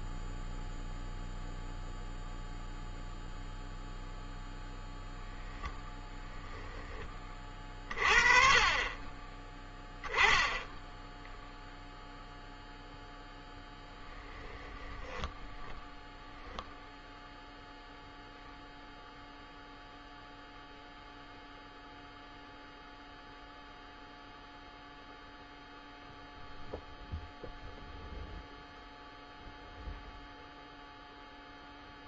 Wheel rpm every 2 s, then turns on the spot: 0, 0, 0, 30, 40, 10, 0, 10, 0, 0, 0, 0, 0, 0, 0, 0.
14-16